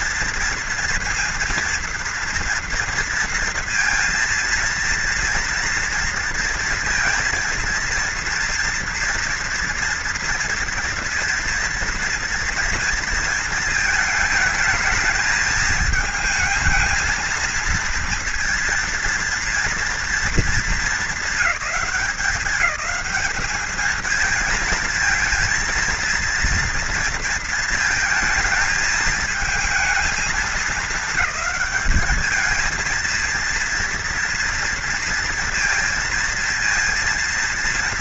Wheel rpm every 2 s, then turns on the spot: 230, 240, 230, 230, 230, 230, 230, 220, 230, 230, 220, 180, 230, 230, 220, 220, 220, 230, 230.
none